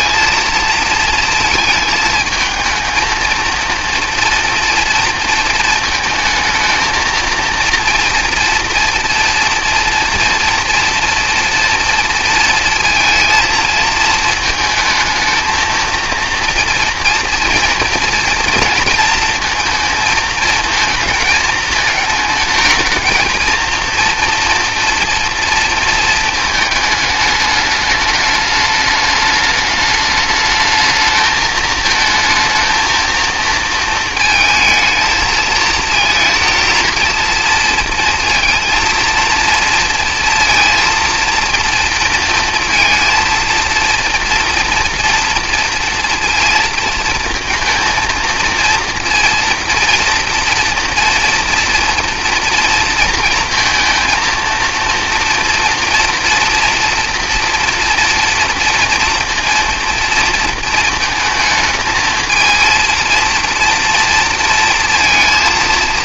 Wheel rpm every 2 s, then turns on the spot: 230, 220, 230, 220, 230, 230, 230, 220, 230, 230, 220, 220, 230, 220, 210, 210, 230, 220, 220, 230, 230, 230, 230, 230, 230, 230, 230, 230, 230, 230, 230, 230, 230.
none